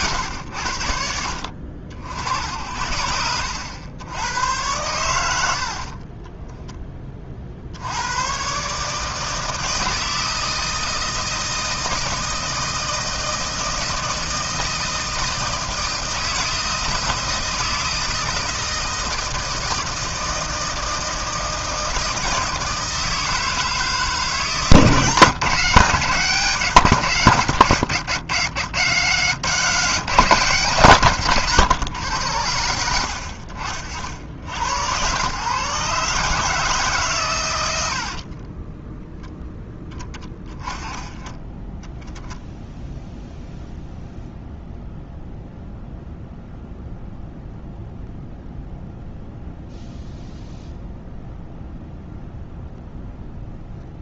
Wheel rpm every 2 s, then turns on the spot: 80, 70, 110, 10, 150, 160, 160, 160, 160, 160, 160, 160, 160, 130, 130, 170, 80, 90, 150, 20, 10, 0, 0, 0, 0, 0, 0.
none